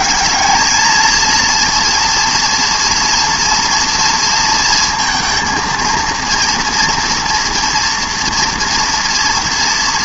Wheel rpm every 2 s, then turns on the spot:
200, 230, 230, 230, 230.
none